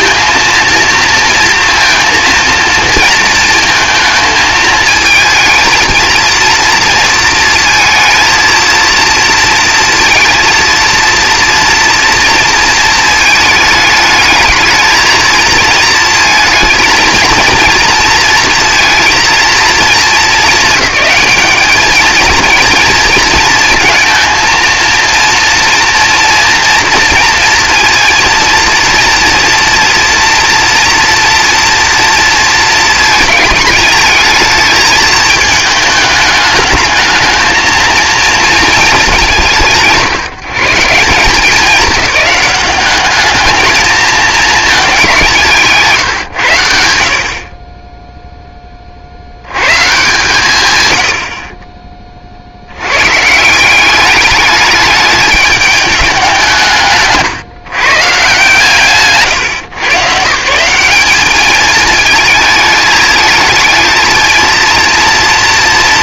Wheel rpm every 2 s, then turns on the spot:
230, 230, 220, 230, 230, 230, 230, 220, 230, 230, 200, 230, 230, 230, 230, 230, 220, 220, 220, 210, 160, 200, 200, 60, 30, 120, 100, 210, 160, 140, 190, 220, 230.
none